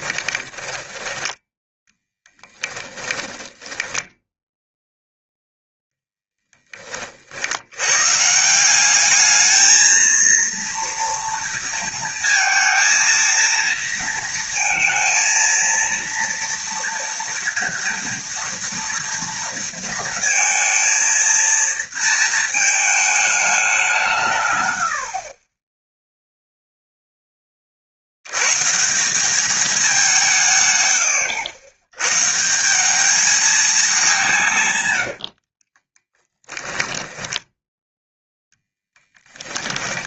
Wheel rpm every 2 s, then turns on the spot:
10, 10, 0, 40, 200, 230, 230, 230, 230, 230, 230, 220, 70, 0, 160, 120, 190, 110, 10, 10.
0-4 34-38